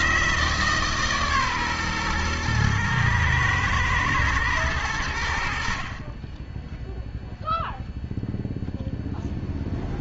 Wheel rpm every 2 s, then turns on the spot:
160, 120, 110, 10, 0.
none